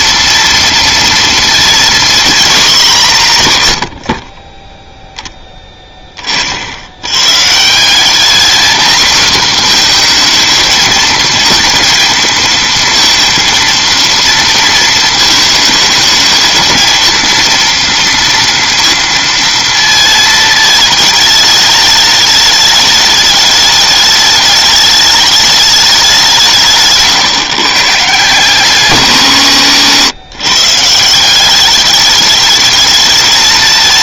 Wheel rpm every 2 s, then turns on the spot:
230, 190, 10, 80, 240, 230, 230, 230, 230, 230, 220, 210, 210, 160, 160, 140, 210.
none